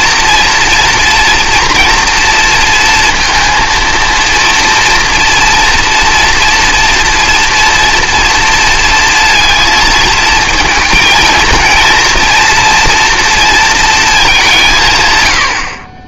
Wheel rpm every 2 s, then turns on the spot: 230, 230, 230, 230, 230, 220, 230, 180.
none